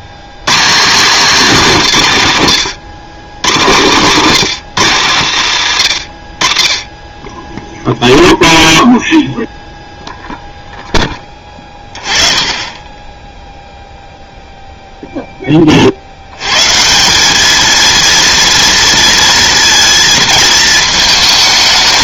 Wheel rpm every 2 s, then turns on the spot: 170, 130, 150, 40, 0, 0, 20, 0, 120, 230, 220.
none